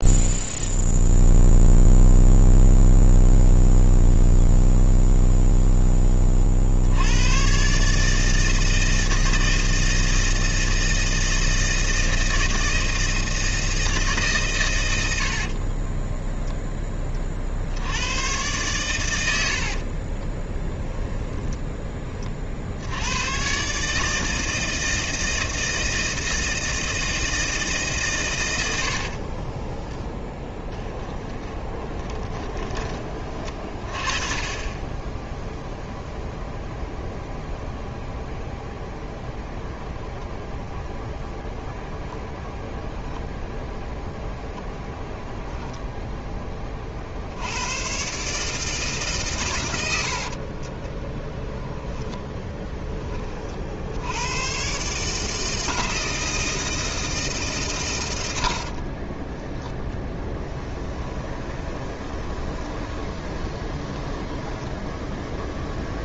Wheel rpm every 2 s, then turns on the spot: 0, 0, 0, 40, 160, 160, 160, 140, 10, 120, 30, 50, 160, 160, 130, 10, 20, 30, 0, 0, 0, 0, 0, 10, 140, 70, 20, 120, 160, 90, 10, 20, 10.
20-22 30-34 50-54 58-66